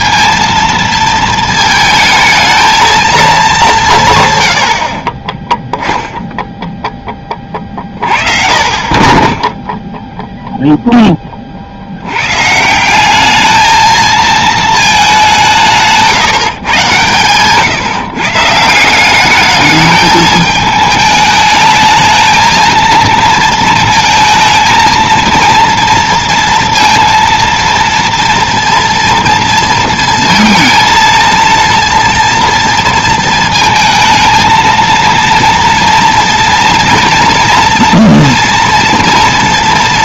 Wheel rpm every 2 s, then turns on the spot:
230, 220, 100, 0, 40, 0, 130, 220, 130, 150, 210, 230, 220, 230, 230, 220, 230, 230, 230, 230.
none